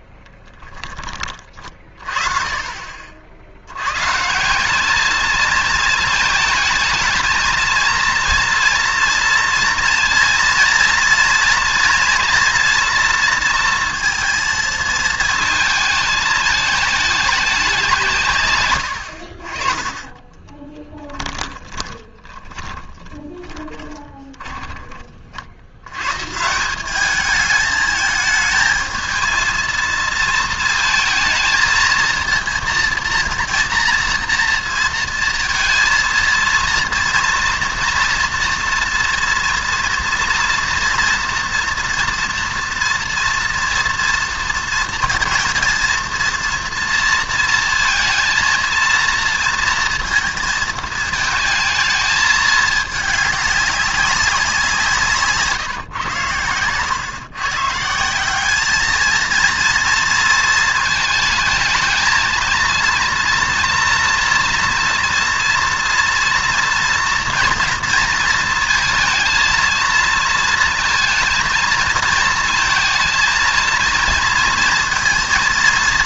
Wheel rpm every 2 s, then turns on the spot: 10, 40, 190, 220, 240, 230, 240, 230, 210, 120, 20, 30, 10, 170, 220, 220, 230, 230, 230, 230, 230, 230, 230, 230, 230, 220, 210, 180, 110, 210, 220, 230, 230, 230, 230, 220, 230, 230.
20-24 56-58